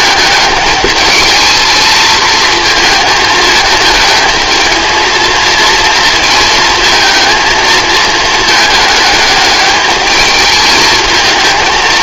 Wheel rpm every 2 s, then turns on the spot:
210, 220, 220, 220, 210, 220.
none